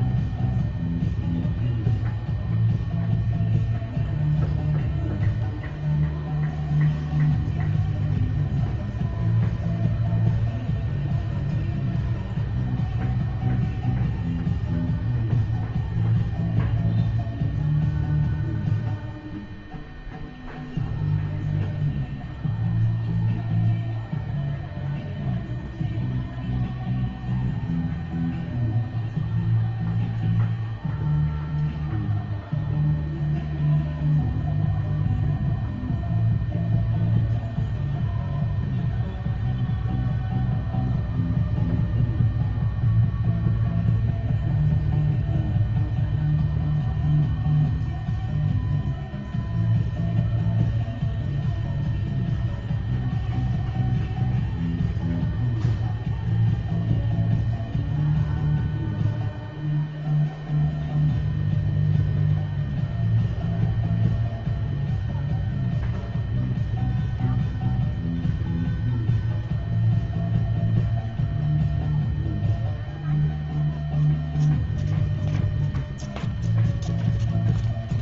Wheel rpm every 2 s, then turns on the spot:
0, 0, 0, 0, 0, 0, 0, 0, 0, 0, 0, 0, 0, 0, 0, 0, 0, 0, 0, 0, 0, 0, 0, 0, 0, 0, 0, 0, 0, 0, 0, 0, 0, 0, 0, 0, 0, 0, 0.
none